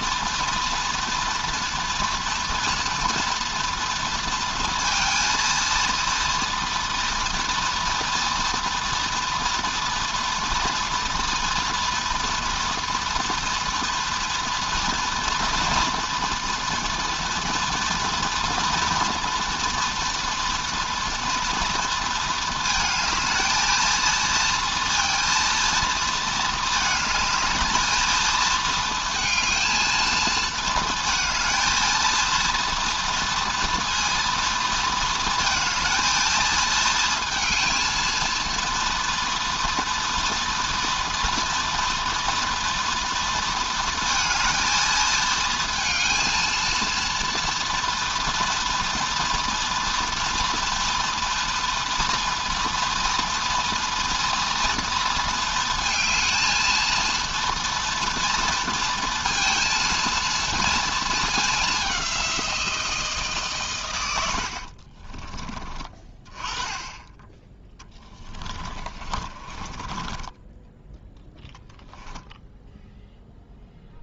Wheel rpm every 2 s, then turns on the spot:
230, 230, 230, 230, 230, 230, 230, 240, 230, 240, 230, 220, 230, 230, 220, 220, 230, 230, 220, 230, 230, 230, 230, 230, 230, 230, 240, 230, 220, 230, 230, 190, 80, 30, 10, 20, 0.
68-72